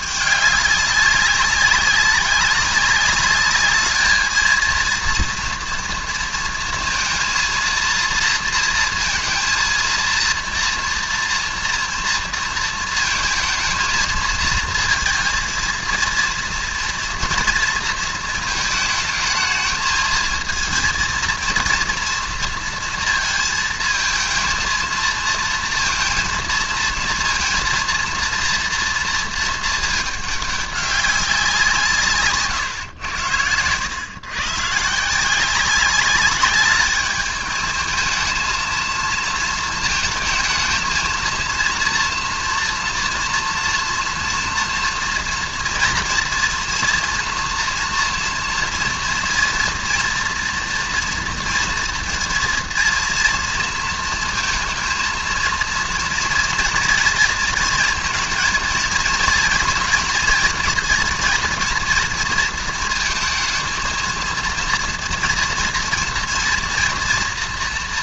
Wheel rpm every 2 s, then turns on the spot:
210, 190, 230, 230, 230, 230, 230, 230, 230, 220, 230, 230, 230, 230, 230, 200, 130, 140, 210, 220, 220, 240, 230, 230, 230, 230, 230, 230, 230, 230, 230, 230, 230, 230.
none